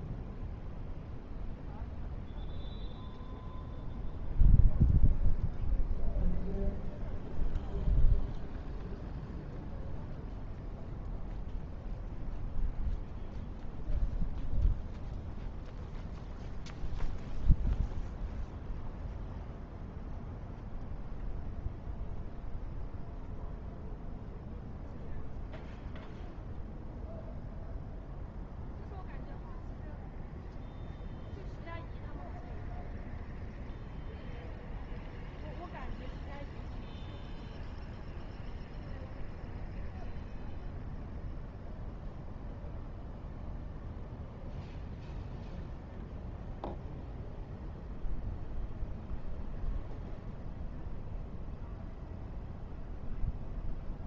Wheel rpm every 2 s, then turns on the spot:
0, 0, 0, 0, 0, 0, 0, 0, 0, 0, 0, 0, 0, 0, 0, 0, 0, 0, 0, 0, 0, 0, 0, 0, 0, 0, 0.
none